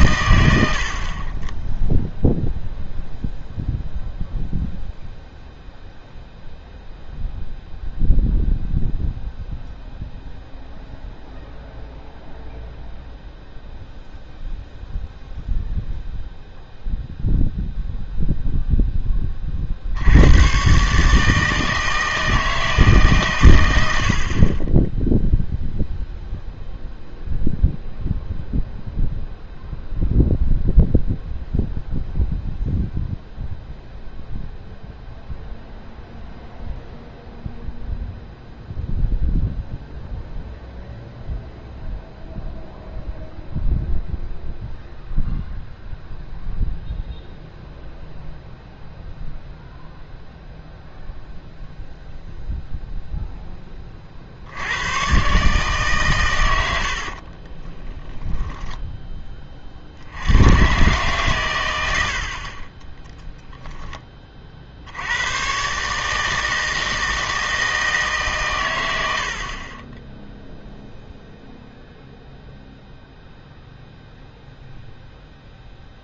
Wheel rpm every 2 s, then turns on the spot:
70, 0, 0, 0, 0, 0, 0, 0, 0, 0, 130, 160, 20, 0, 0, 0, 0, 0, 0, 0, 0, 0, 0, 0, 0, 0, 0, 90, 90, 10, 120, 20, 60, 160, 110, 0, 0, 0.
58-60 62-64